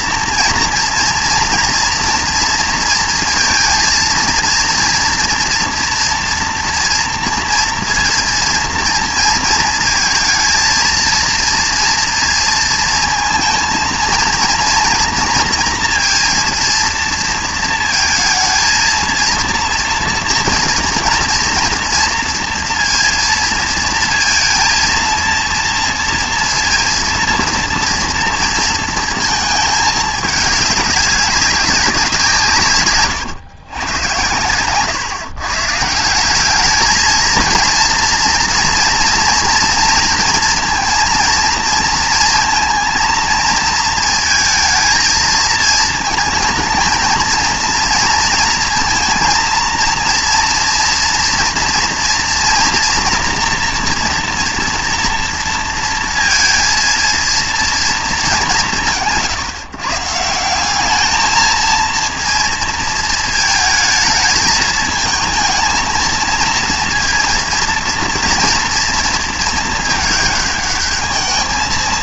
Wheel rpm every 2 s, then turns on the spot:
240, 230, 230, 240, 230, 220, 230, 230, 230, 230, 230, 230, 230, 230, 230, 200, 130, 120, 220, 230, 230, 230, 230, 220, 230, 230, 240, 240, 230, 180, 190, 230, 220, 230, 230, 210.
34-36